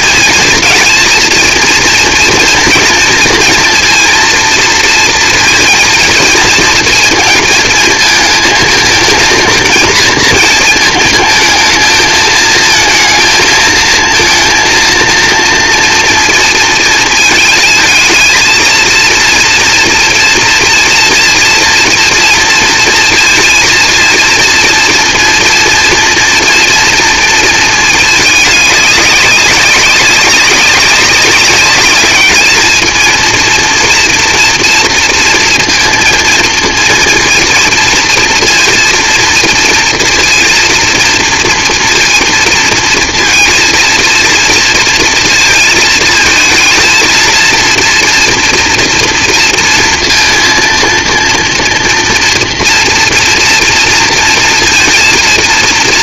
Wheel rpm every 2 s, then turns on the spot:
230, 230, 230, 230, 220, 230, 220, 230, 230, 230, 230, 230, 230, 230, 210, 200, 220, 230, 230, 230, 230, 230, 230, 220, 230, 230, 230, 230.
none